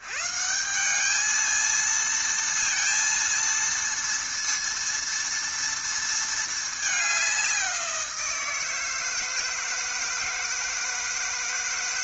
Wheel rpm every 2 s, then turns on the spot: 180, 230, 230, 210, 160, 160.
none